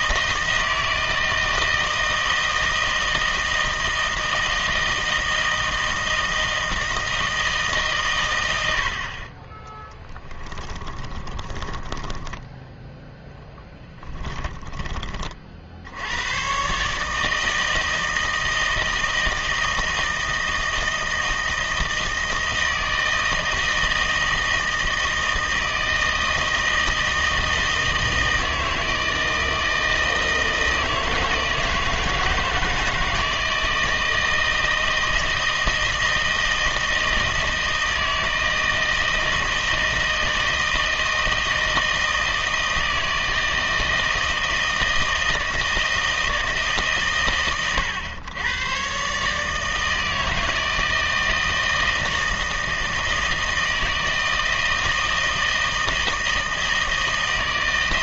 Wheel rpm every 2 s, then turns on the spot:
160, 160, 160, 160, 80, 20, 0, 20, 130, 160, 160, 160, 160, 160, 160, 160, 160, 160, 160, 160, 160, 160, 160, 160, 130, 160, 160, 160, 160.
10-12 14-16